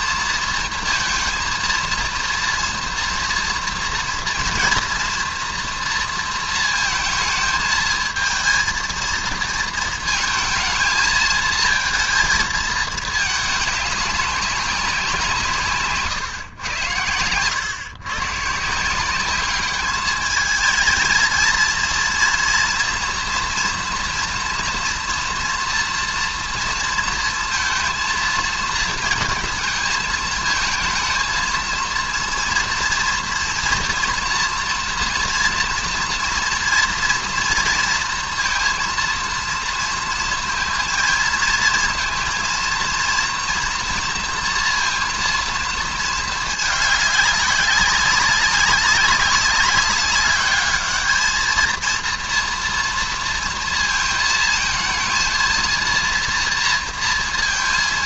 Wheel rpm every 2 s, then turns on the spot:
230, 230, 230, 230, 220, 220, 220, 200, 120, 150, 220, 240, 230, 230, 230, 220, 230, 230, 230, 230, 230, 230, 230, 210, 200, 210, 230, 220, 230.
none